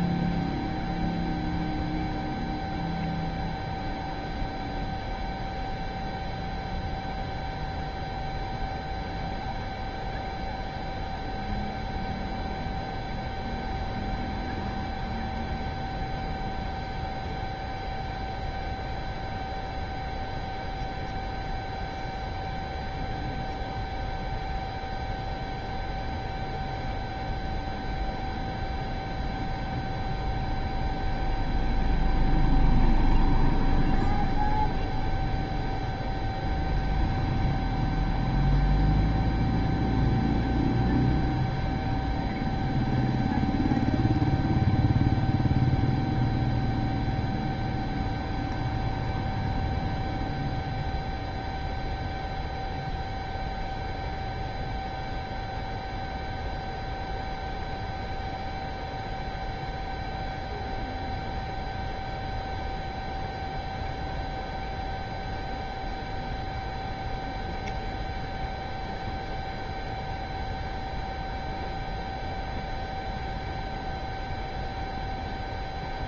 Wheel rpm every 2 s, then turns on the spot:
0, 0, 0, 0, 0, 0, 0, 0, 0, 0, 0, 0, 0, 0, 0, 0, 0, 0, 0, 0, 0, 0, 0, 0, 0, 0, 0, 0, 0, 0, 0, 0, 0, 0, 0, 0, 0, 0.
none